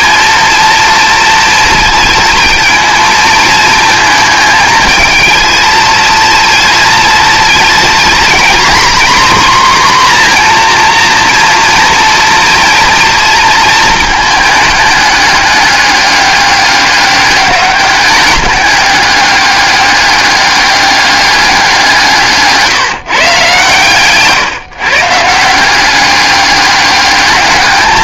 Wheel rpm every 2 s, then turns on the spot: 230, 220, 220, 230, 250, 240, 230, 210, 200, 200, 200, 150, 140, 200.
none